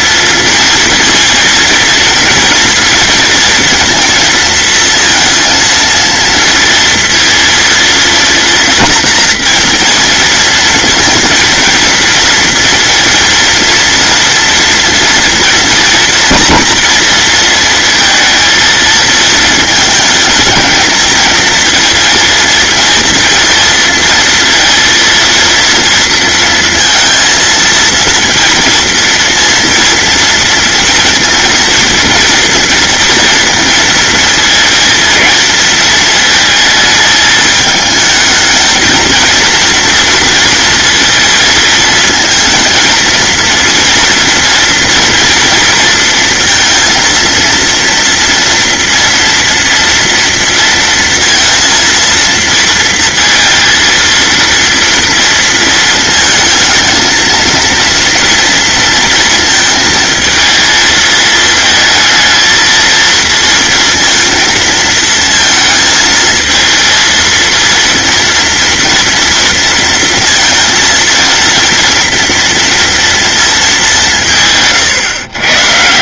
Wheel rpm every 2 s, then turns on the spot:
230, 230, 230, 230, 230, 220, 230, 230, 230, 220, 220, 230, 230, 230, 230, 230, 230, 220, 220, 220, 230, 230, 230, 230, 230, 230, 230, 230, 230, 230, 220, 230, 230, 220, 230, 230, 230, 130.
none